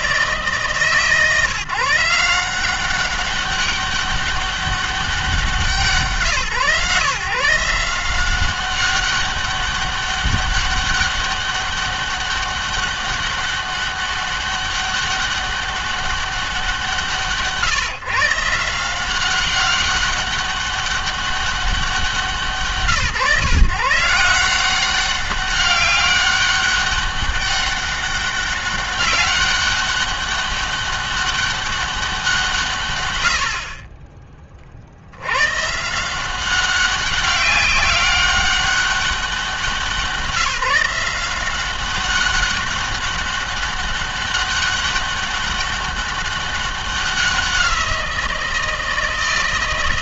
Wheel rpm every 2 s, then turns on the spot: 150, 180, 200, 150, 190, 200, 200, 200, 180, 170, 200, 160, 170, 200, 200, 200, 140, 40, 190, 200, 160, 200, 200, 190, 170.
none